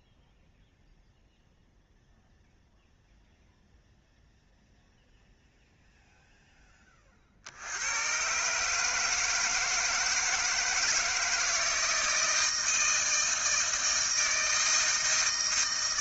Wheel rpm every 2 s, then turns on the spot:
0, 0, 0, 20, 150, 160, 160, 160.
none